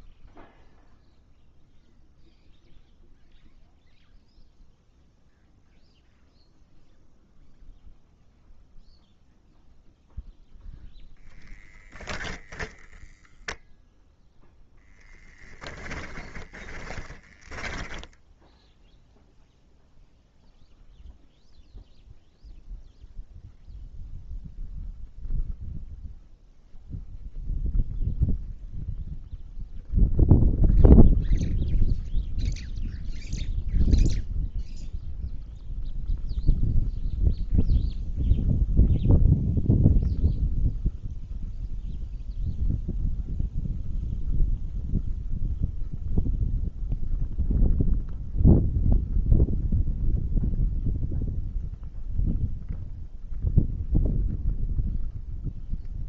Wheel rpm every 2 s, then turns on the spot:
0, 0, 0, 0, 0, 0, 0, 10, 20, 0, 0, 0, 0, 0, 0, 0, 0, 0, 0, 0, 0, 0, 0, 0, 0, 0, 0, 0.
14-18